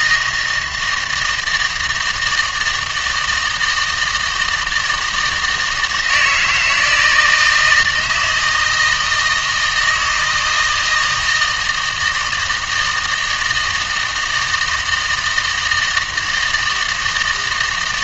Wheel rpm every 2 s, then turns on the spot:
160, 160, 160, 160, 160, 160, 160, 160, 160.
none